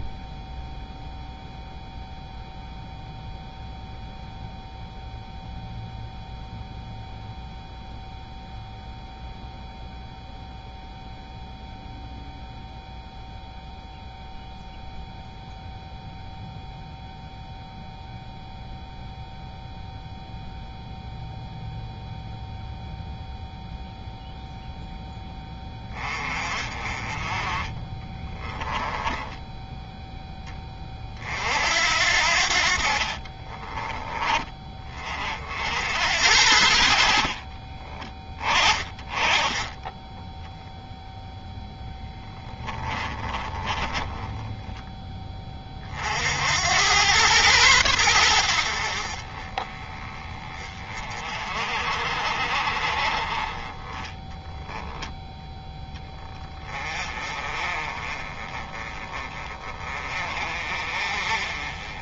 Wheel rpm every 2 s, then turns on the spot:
0, 0, 0, 0, 0, 0, 0, 0, 0, 0, 0, 0, 0, 30, 10, 30, 50, 30, 70, 30, 0, 20, 10, 100, 50, 30, 40, 10, 30, 30, 40.
28-30 32-34 42-44